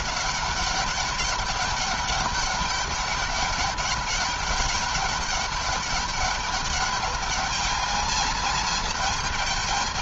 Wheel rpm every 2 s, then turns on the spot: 200, 200, 200, 210, 220.
none